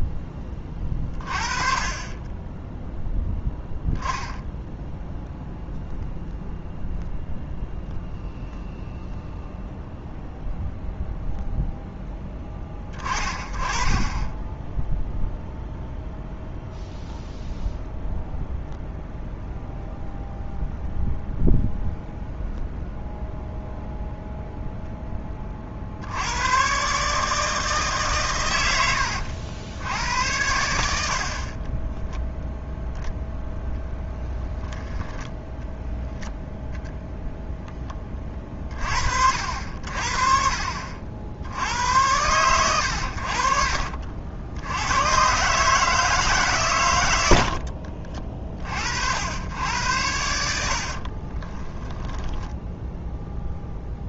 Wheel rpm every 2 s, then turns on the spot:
30, 0, 0, 0, 0, 0, 30, 0, 0, 0, 0, 0, 0, 130, 90, 80, 0, 10, 0, 40, 50, 100, 90, 130, 60, 50, 0.
28-30 34-36 50-52